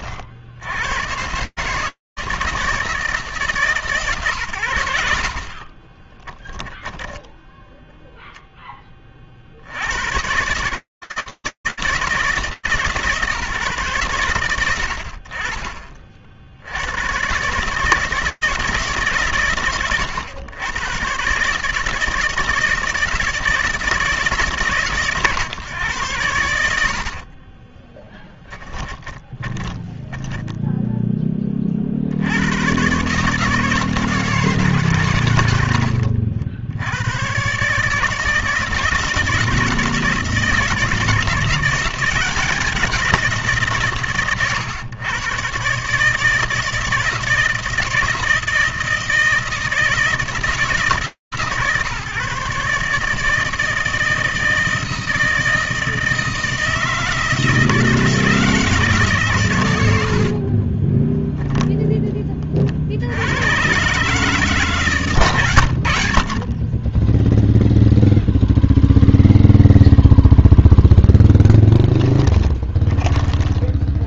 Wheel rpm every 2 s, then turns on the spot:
140, 160, 50, 10, 60, 160, 130, 30, 120, 110, 130, 170, 120, 20, 10, 40, 160, 80, 140, 160, 170, 150, 140, 160, 160, 150, 160, 160, 160, 70, 0, 110, 90, 0, 0, 10, 10.
26-30 72-74